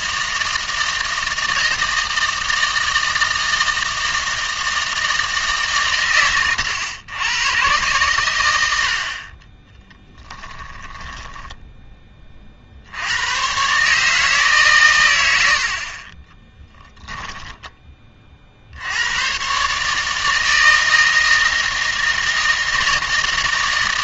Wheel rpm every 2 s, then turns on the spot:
160, 160, 160, 120, 100, 10, 60, 130, 20, 70, 160, 160.
10-12 16-18